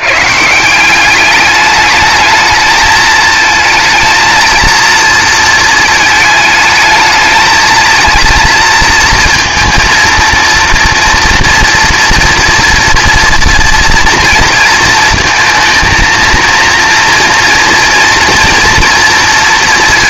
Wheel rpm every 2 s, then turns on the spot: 180, 220, 230, 220, 230, 230, 230, 230, 230, 230.
none